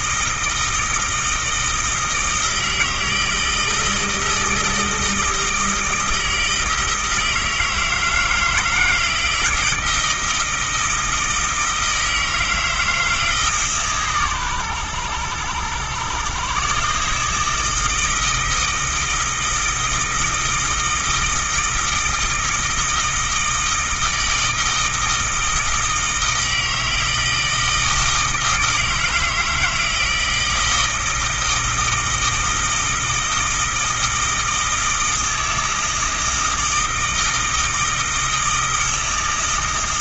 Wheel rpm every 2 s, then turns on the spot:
160, 160, 160, 160, 160, 160, 160, 110, 140, 160, 160, 160, 160, 160, 160, 160, 160, 160, 160, 160.
none